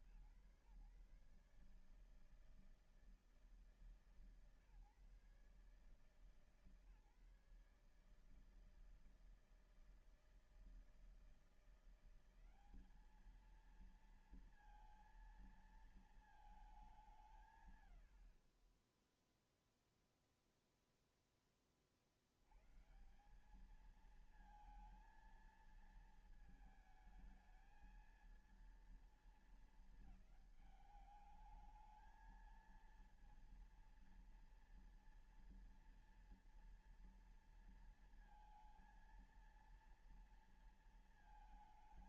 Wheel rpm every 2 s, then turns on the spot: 140, 160, 150, 150, 160, 160, 200, 230, 210, 30, 0, 130, 220, 220, 230, 210, 220, 230, 240, 230, 230.
none